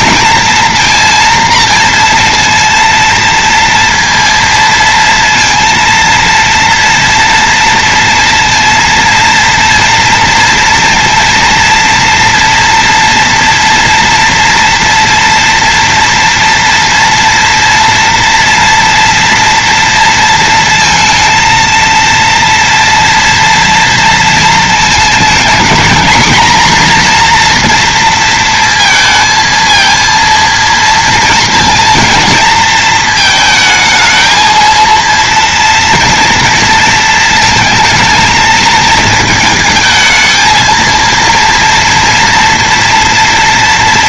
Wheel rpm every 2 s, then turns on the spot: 230, 230, 230, 240, 230, 230, 230, 230, 230, 230, 230, 230, 220, 240, 230, 230, 220, 230, 220, 220, 220, 230.
none